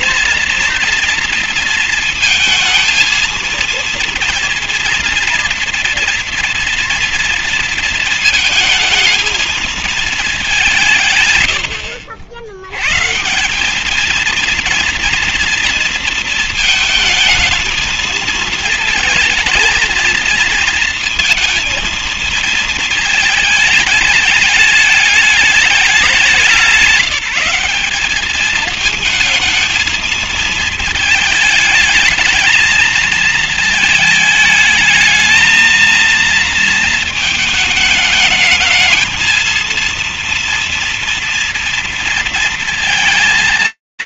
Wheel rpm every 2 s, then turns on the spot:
230, 230, 240, 240, 220, 190, 100, 230, 230, 220, 220, 230, 210, 180, 220, 220, 220, 220, 230, 220, 230, 230.
none